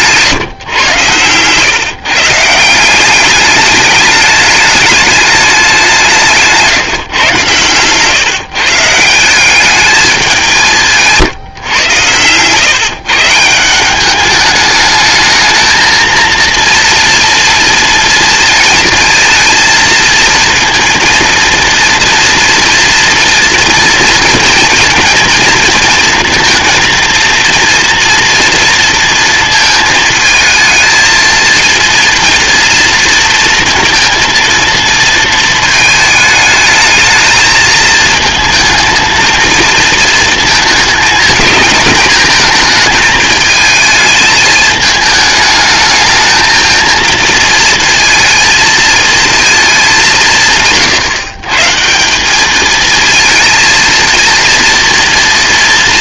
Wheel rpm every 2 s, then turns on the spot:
150, 160, 210, 170, 140, 190, 120, 200, 230, 230, 220, 230, 230, 230, 230, 220, 230, 230, 220, 220, 230, 220, 220, 220, 230, 160, 200, 230.
6-8